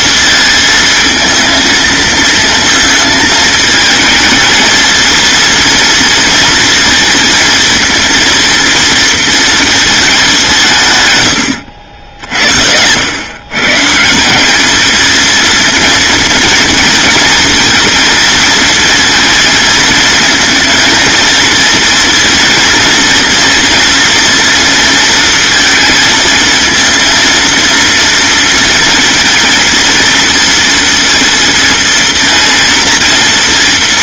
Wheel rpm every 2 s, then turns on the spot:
230, 220, 220, 230, 230, 130, 90, 220, 230, 230, 230, 230, 230, 230, 230, 230, 240.
none